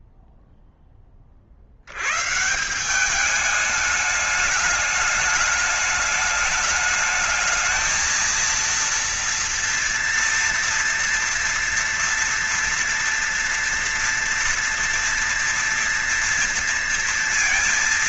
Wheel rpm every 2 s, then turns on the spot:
10, 150, 210, 210, 230, 240, 230, 230, 230.
none